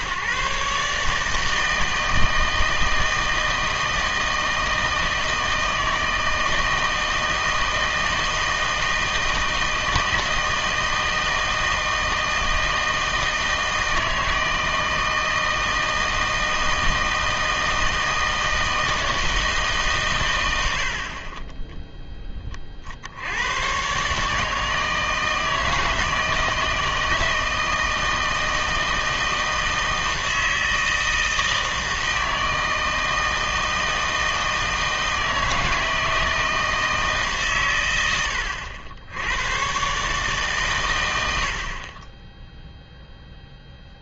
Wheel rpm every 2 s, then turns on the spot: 140, 160, 160, 160, 160, 160, 160, 160, 160, 160, 90, 30, 160, 160, 160, 160, 160, 160, 160, 80, 130, 0.
none